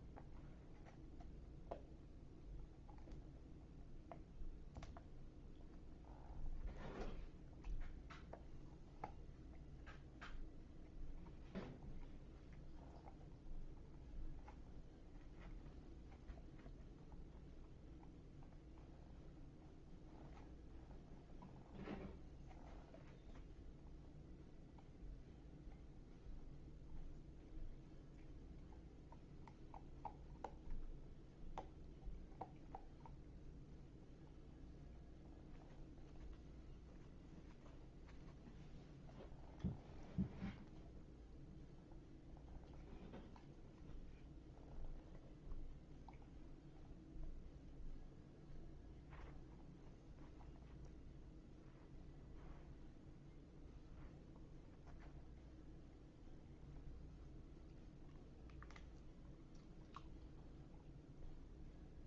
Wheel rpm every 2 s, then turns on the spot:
0, 0, 0, 0, 0, 0, 0, 0, 0, 0, 0, 0, 0, 0, 0, 0, 0, 0, 0, 0, 0, 0, 0, 0, 0, 0, 0, 0, 0, 0, 0.
none